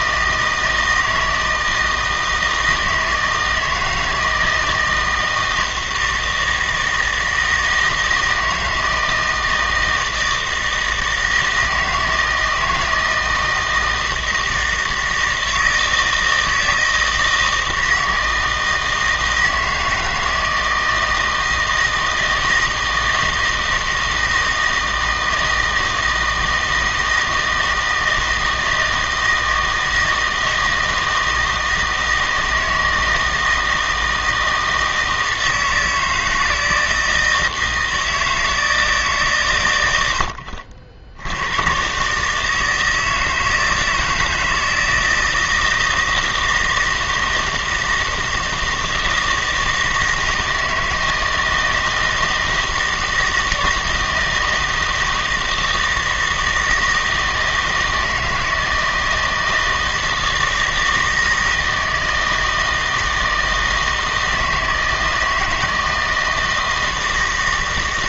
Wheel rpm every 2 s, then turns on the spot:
160, 160, 160, 160, 160, 160, 160, 160, 160, 160, 160, 160, 160, 160, 160, 160, 160, 160, 160, 160, 70, 160, 160, 160, 160, 160, 160, 160, 160, 160, 160, 160, 160, 160.
none